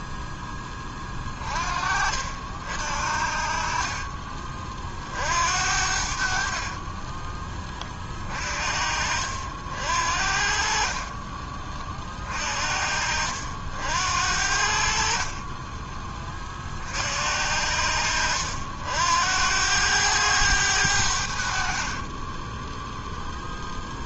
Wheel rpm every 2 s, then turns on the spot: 10, 60, 40, 40, 40, 50, 40, 60, 40, 70, 100, 10.
22-24